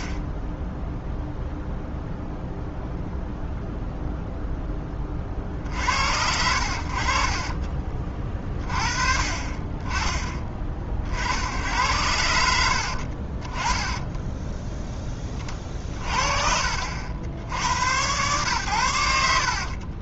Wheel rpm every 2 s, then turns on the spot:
10, 0, 10, 70, 30, 30, 70, 10, 60, 110.
none